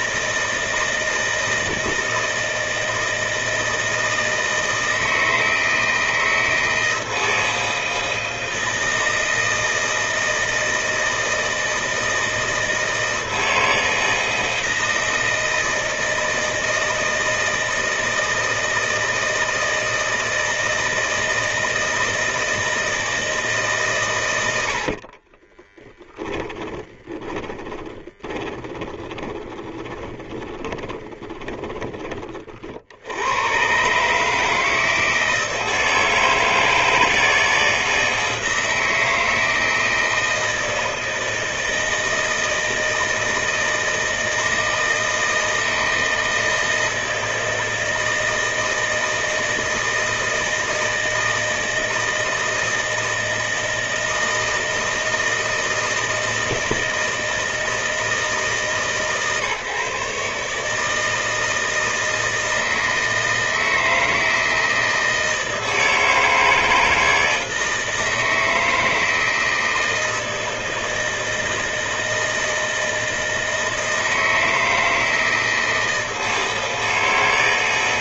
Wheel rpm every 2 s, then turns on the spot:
160, 160, 160, 160, 160, 160, 160, 160, 160, 160, 160, 160, 120, 20, 20, 10, 40, 150, 160, 160, 160, 160, 160, 160, 160, 160, 160, 160, 160, 160, 150, 160, 160, 160, 160, 160, 160, 160, 160.
26-32